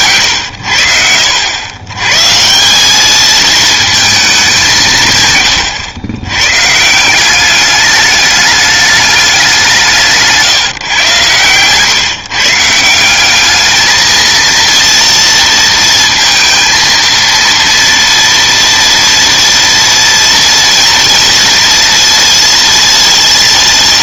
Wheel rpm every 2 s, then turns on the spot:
90, 160, 190, 110, 210, 160, 150, 230, 230, 230, 230, 230.
none